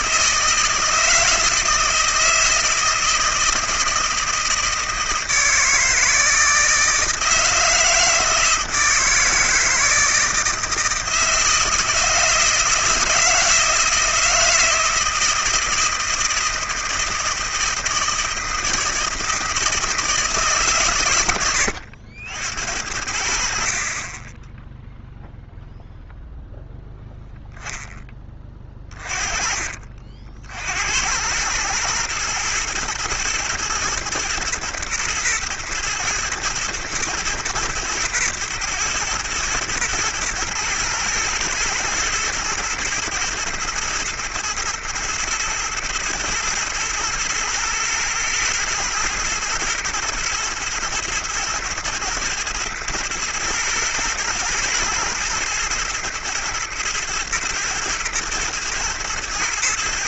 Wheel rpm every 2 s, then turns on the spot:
160, 160, 160, 160, 160, 160, 160, 160, 160, 160, 130, 70, 10, 0, 30, 70, 120, 110, 120, 110, 110, 110, 120, 120, 110, 110, 110, 110, 110, 110.
24-26